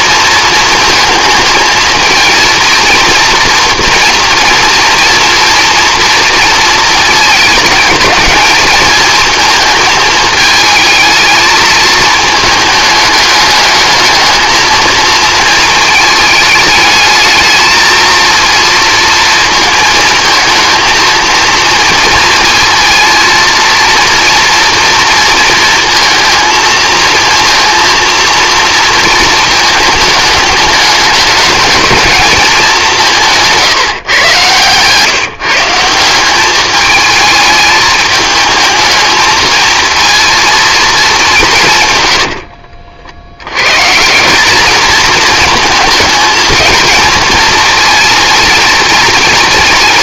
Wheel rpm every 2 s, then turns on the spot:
230, 230, 230, 230, 220, 220, 210, 220, 220, 230, 220, 230, 230, 230, 230, 210, 200, 130, 210, 220, 230, 60, 200, 220, 230.
42-44